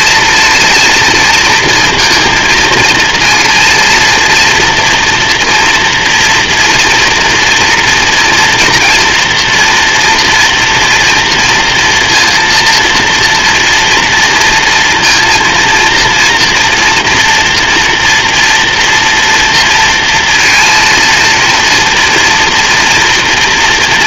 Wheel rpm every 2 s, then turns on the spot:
230, 230, 240, 240, 230, 230, 230, 230, 240, 230, 230, 230.
none